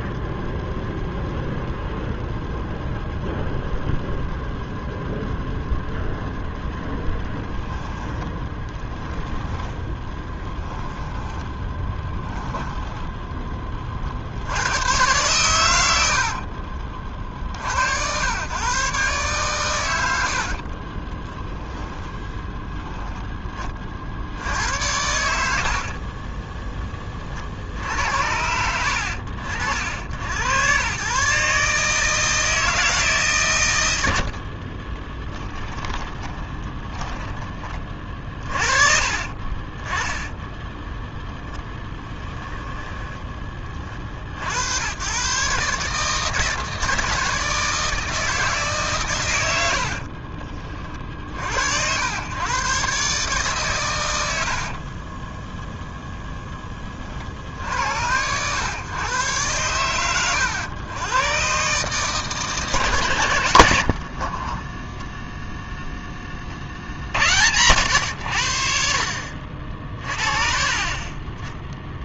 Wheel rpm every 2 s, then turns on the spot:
0, 0, 0, 10, 10, 10, 10, 110, 40, 130, 40, 10, 80, 20, 70, 110, 150, 30, 20, 30, 0, 10, 100, 160, 140, 40, 140, 40, 30, 120, 110, 130, 10, 60, 60, 30.
8-14 20-22 34-38 42-44 54-56